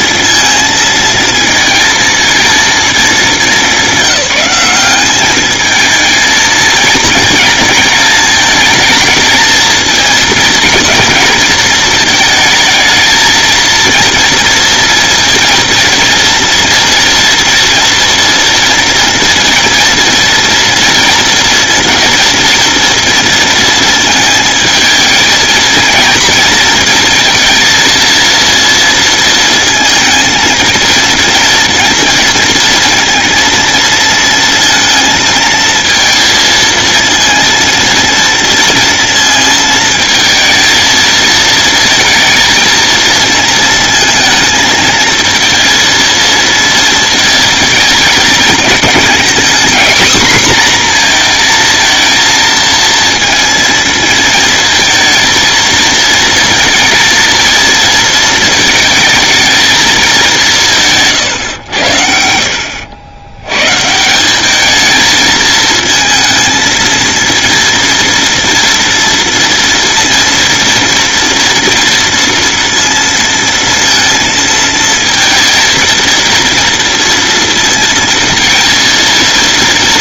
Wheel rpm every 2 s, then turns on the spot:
230, 220, 190, 230, 220, 230, 220, 230, 230, 230, 230, 230, 220, 230, 230, 230, 230, 230, 220, 230, 220, 230, 220, 230, 210, 250, 230, 220, 230, 220, 170, 70, 210, 230, 230, 230, 230, 230, 240, 230.
none